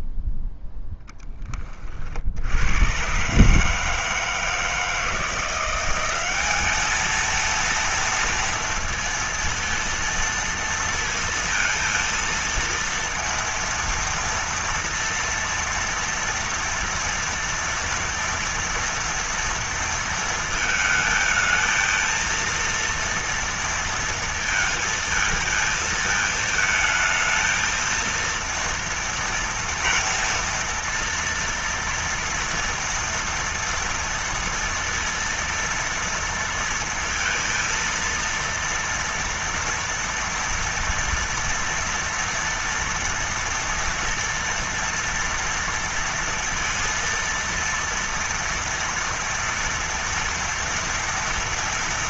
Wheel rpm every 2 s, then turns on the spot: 0, 40, 160, 180, 230, 230, 230, 230, 230, 230, 230, 220, 230, 220, 230, 230, 230, 230, 230, 230, 240, 230, 230, 230, 230, 230.
none